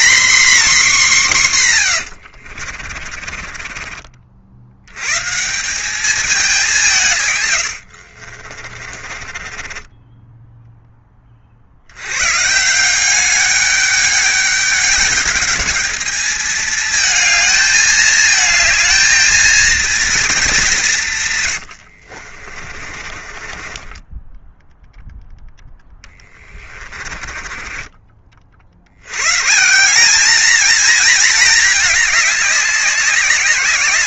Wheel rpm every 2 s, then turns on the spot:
270, 40, 90, 180, 30, 10, 170, 210, 220, 220, 190, 30, 0, 20, 80, 230, 200.
2-4 8-10 22-24 26-28